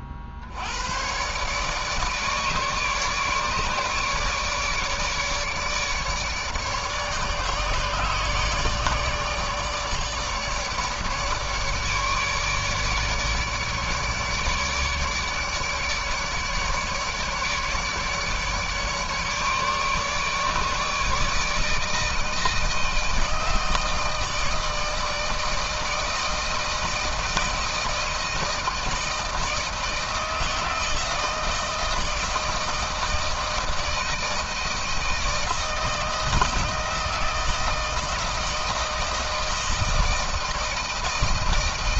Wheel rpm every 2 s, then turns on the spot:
60, 150, 150, 150, 150, 150, 150, 150, 150, 150, 150, 160, 160, 160, 160, 160, 160, 160, 160, 160, 160.
none